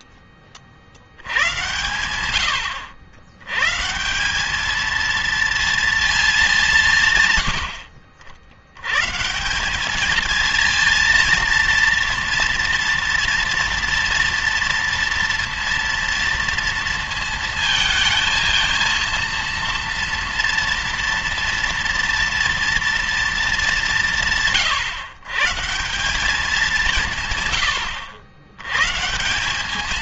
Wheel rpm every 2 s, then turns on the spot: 60, 90, 210, 170, 110, 230, 230, 230, 230, 230, 230, 230, 150, 180, 110.
none